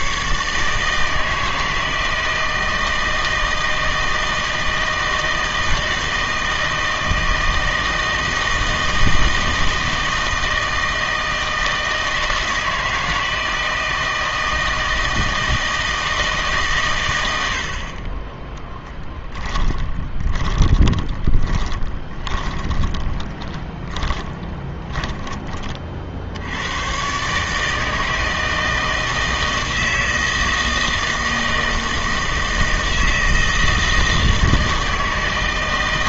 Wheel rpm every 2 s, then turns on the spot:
150, 160, 160, 160, 160, 160, 160, 160, 130, 10, 20, 20, 10, 90, 160, 160, 160, 160.
18-26